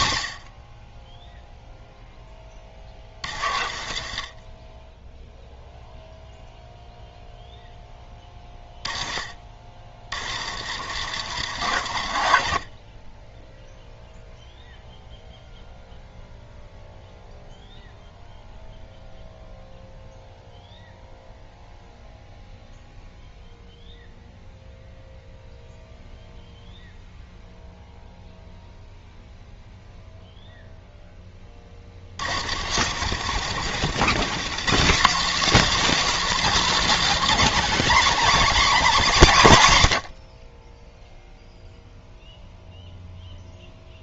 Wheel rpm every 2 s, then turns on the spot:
70, 30, 30, 0, 20, 100, 50, 0, 0, 0, 0, 0, 0, 0, 0, 0, 100, 190, 260, 230, 30, 0.
2-6 8-14 32-34